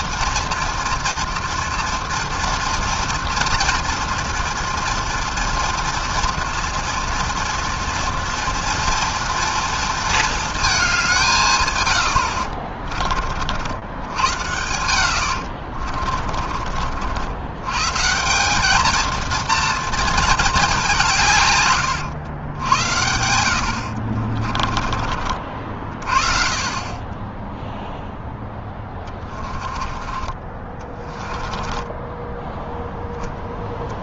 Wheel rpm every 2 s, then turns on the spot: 230, 230, 230, 230, 230, 220, 60, 80, 50, 190, 210, 90, 30, 30, 10, 20, 10.
12-14 16-18 24-26 28-30